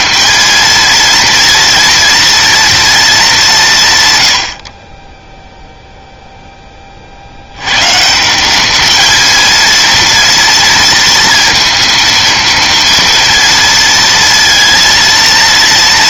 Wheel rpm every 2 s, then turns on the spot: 230, 230, 80, 0, 180, 230, 230, 230.
none